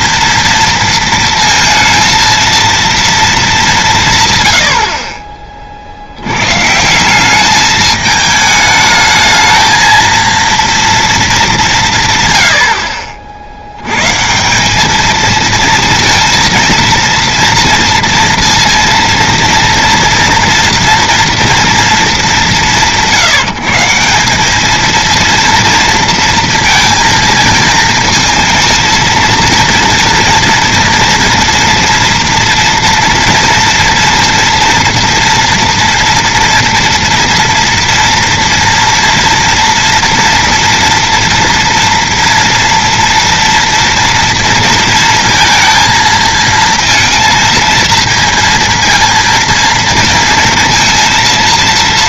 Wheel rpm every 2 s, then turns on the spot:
230, 230, 120, 120, 220, 230, 80, 180, 230, 230, 230, 180, 210, 230, 230, 230, 230, 230, 230, 240, 230, 230, 230, 230, 230, 230.
none